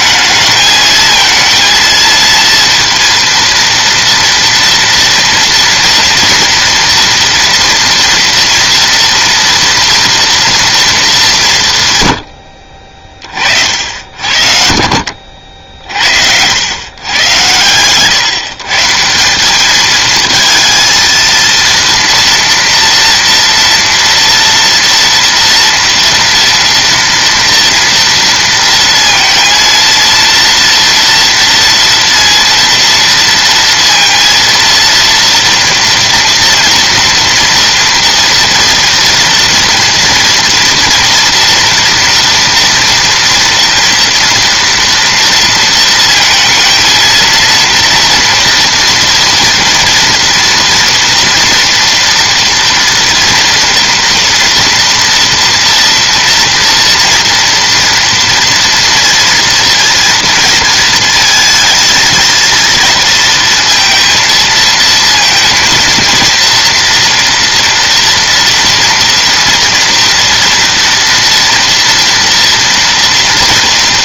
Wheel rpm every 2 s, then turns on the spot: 220, 230, 230, 230, 230, 230, 50, 60, 110, 150, 230, 240, 240, 240, 230, 230, 230, 230, 230, 230, 230, 230, 230, 220, 230, 230, 230, 230, 230, 230, 230, 230, 230, 230, 230, 230, 240.
12-14